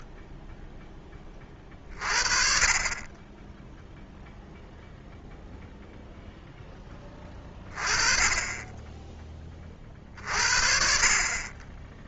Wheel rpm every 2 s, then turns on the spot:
20, 0, 0, 20, 40, 0.
none